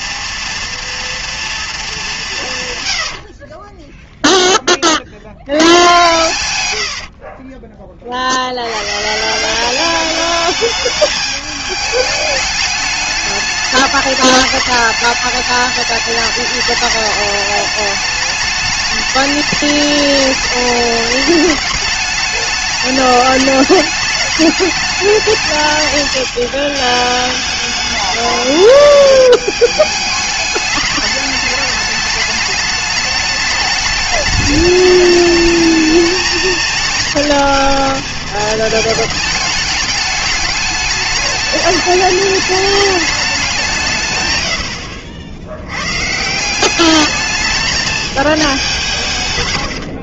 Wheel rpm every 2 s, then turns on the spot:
230, 150, 20, 110, 90, 220, 210, 210, 210, 210, 210, 210, 210, 210, 210, 210, 210, 210, 220, 220, 210, 210, 90, 180, 200.
6-8